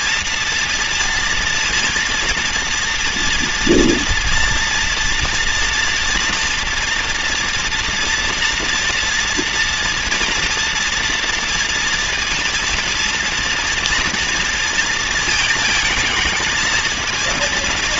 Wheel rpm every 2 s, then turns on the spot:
230, 230, 230, 230, 240, 230, 230, 230, 230.
none